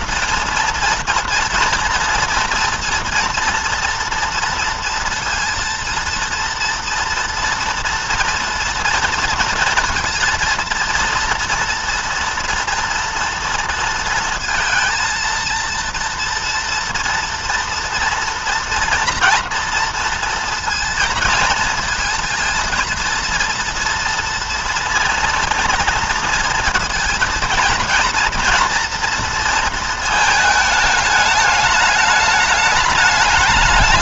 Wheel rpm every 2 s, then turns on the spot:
230, 230, 230, 230, 230, 230, 230, 230, 230, 230, 230, 230, 230, 230, 230, 220, 210.
none